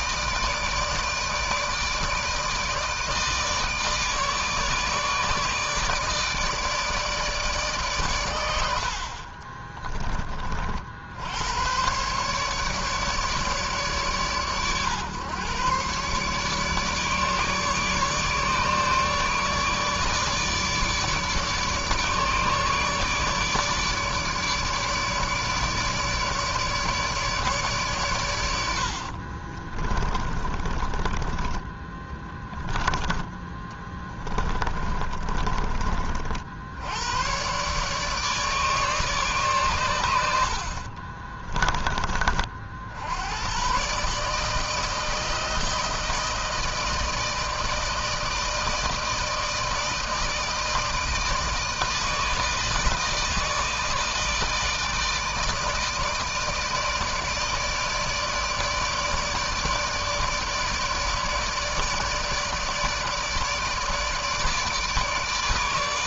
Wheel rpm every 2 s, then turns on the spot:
150, 160, 150, 150, 60, 60, 150, 120, 150, 150, 150, 150, 150, 150, 60, 20, 10, 30, 100, 140, 40, 70, 160, 160, 160, 160, 160, 160, 150, 150, 160, 160, 150.
8-10 28-30 34-36 40-42